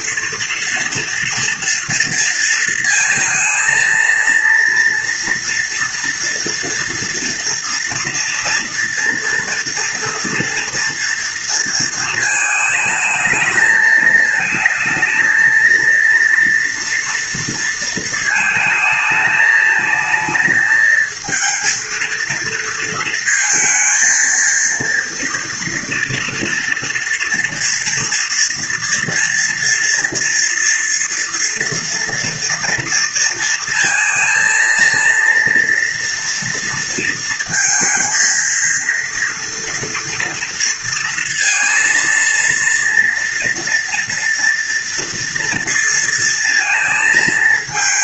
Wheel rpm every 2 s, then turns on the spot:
230, 230, 230, 230, 230, 230, 220, 220, 230, 220, 220, 230, 230, 230, 230, 230, 230, 230, 230, 230, 230, 230, 230, 230.
none